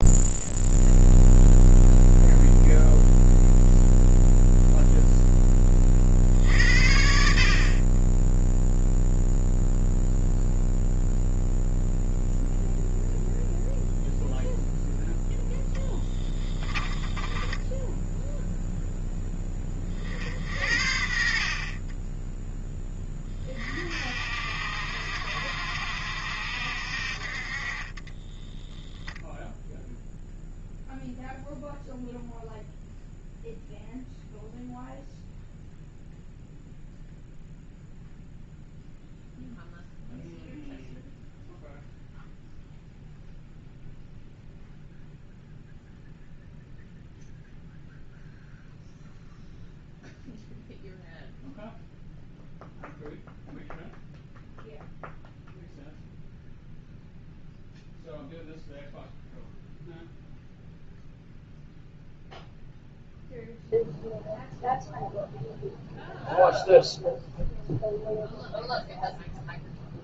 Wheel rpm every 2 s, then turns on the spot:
0, 0, 0, 60, 0, 0, 0, 0, 10, 10, 70, 20, 70, 60, 0, 0, 0, 0, 0, 0, 0, 0, 0, 0, 0, 0, 0, 0, 0, 0, 0, 0, 0, 0, 0.
16-18